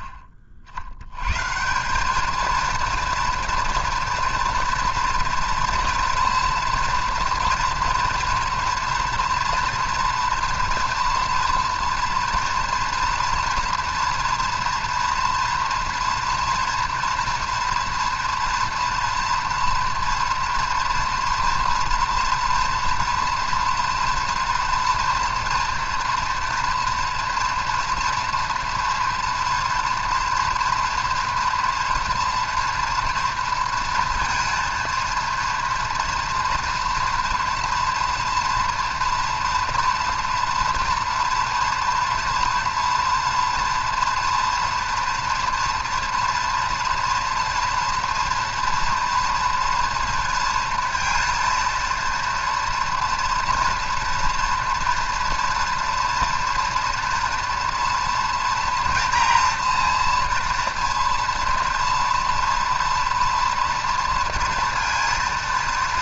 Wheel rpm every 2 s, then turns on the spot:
110, 230, 240, 230, 230, 240, 240, 230, 240, 230, 230, 230, 230, 230, 230, 240, 230, 230, 230, 230, 240, 230, 240, 230, 230, 230, 230, 230, 230, 230, 230, 230, 230.
none